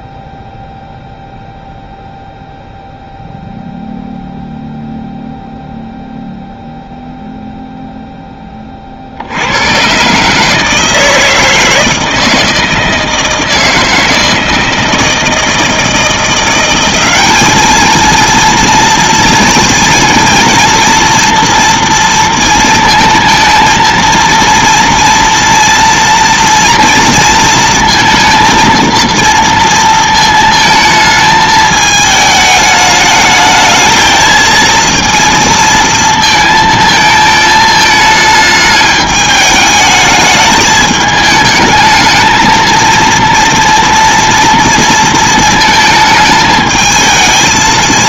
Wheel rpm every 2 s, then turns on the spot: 0, 0, 0, 0, 30, 160, 160, 160, 180, 230, 230, 230, 230, 230, 230, 220, 210, 230, 220, 210, 210, 230, 230, 220.
none